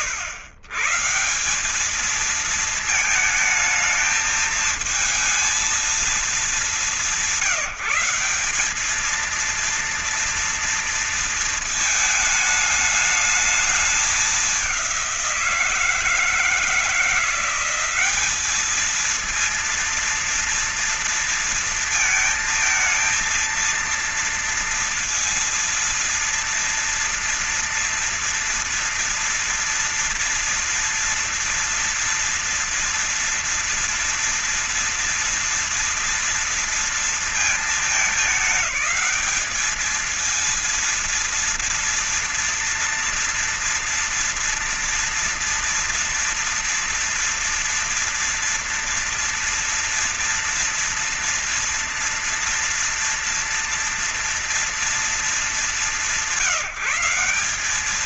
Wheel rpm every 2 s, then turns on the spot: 120, 220, 220, 210, 200, 230, 220, 200, 170, 210, 230, 230, 230, 230, 230, 230, 230, 230, 230, 210, 230, 230, 230, 230, 230, 230, 230, 230, 170.
none